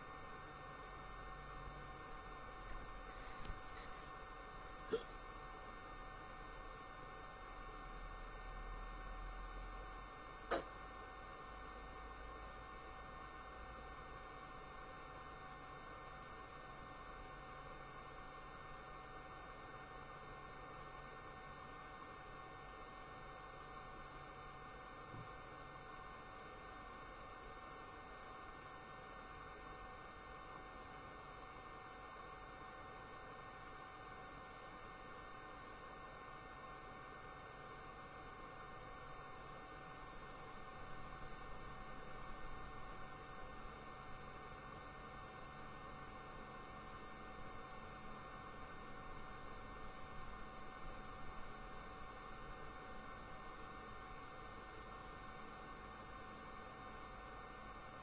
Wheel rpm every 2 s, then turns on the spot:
0, 0, 0, 0, 0, 0, 0, 0, 0, 0, 0, 0, 0, 0, 0, 0, 0, 0, 0, 0, 0, 0, 0, 0, 0, 0, 0, 0, 0.
none